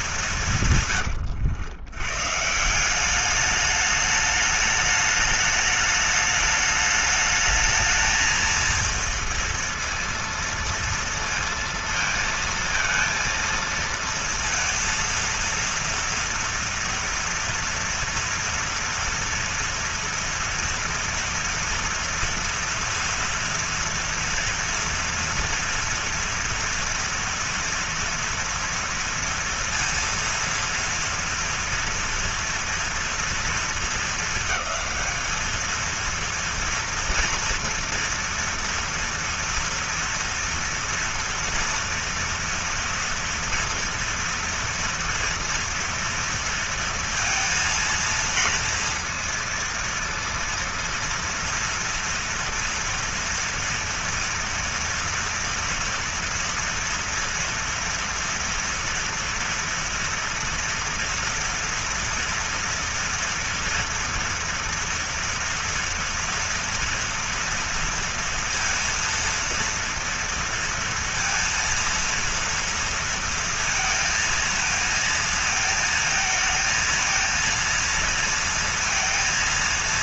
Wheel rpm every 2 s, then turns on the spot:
130, 180, 210, 210, 230, 230, 230, 230, 230, 230, 230, 230, 230, 240, 230, 240, 230, 220, 230, 230, 230, 230, 230, 230, 230, 230, 230, 230, 230, 230, 230, 240, 230, 230, 230, 230, 230, 230, 230, 230.
0-2